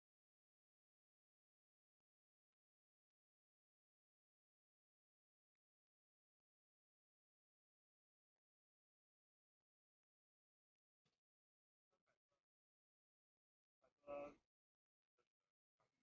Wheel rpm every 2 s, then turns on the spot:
0, 0, 0, 0, 0, 0, 0, 0.
none